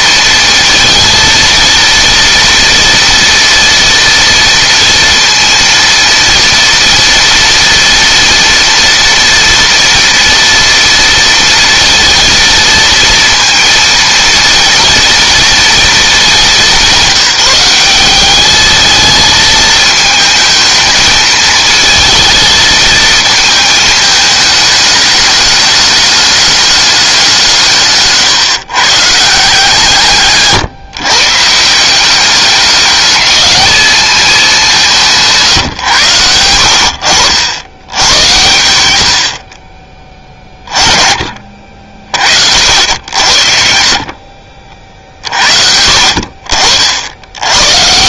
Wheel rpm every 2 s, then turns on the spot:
230, 230, 230, 240, 230, 230, 230, 230, 190, 220, 220, 220, 210, 190, 150, 130, 210, 160, 70, 60, 30, 80, 50, 80.
none